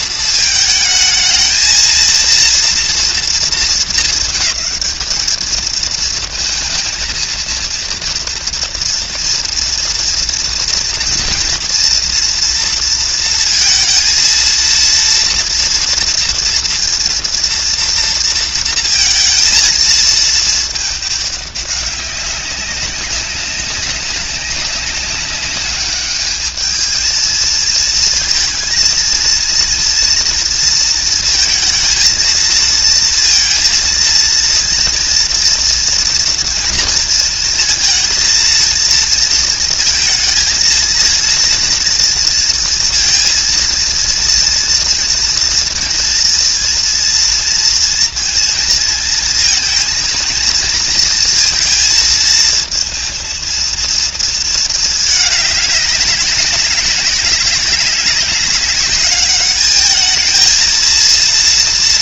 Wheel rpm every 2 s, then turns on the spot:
220, 230, 220, 230, 230, 230, 230, 230, 230, 230, 220, 190, 200, 210, 230, 230, 230, 230, 230, 230, 230, 230, 230, 230, 230, 230, 220, 230, 200, 200, 230.
none